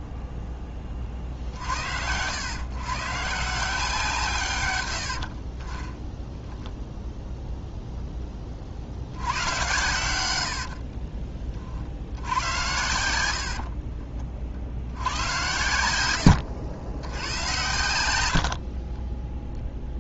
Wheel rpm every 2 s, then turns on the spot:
20, 130, 100, 0, 60, 40, 90, 80, 90, 20.
4-6 10-12 18-20